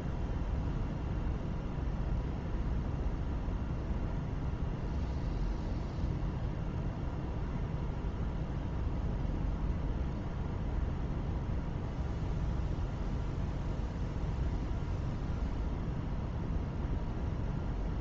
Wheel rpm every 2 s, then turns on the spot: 0, 0, 0, 0, 0, 0, 0, 0, 0.
none